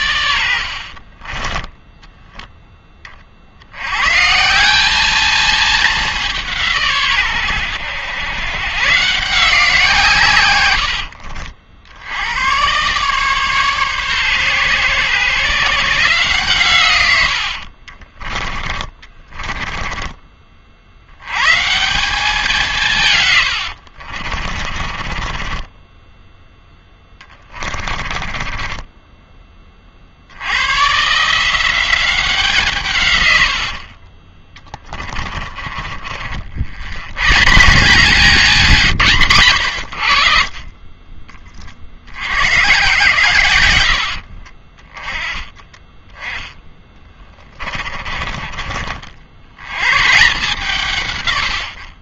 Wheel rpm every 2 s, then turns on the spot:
70, 10, 190, 160, 110, 100, 120, 130, 140, 30, 50, 170, 40, 10, 20, 120, 150, 20, 80, 190, 40, 110, 30, 10, 30, 160.
18-20 24-30 34-36 46-48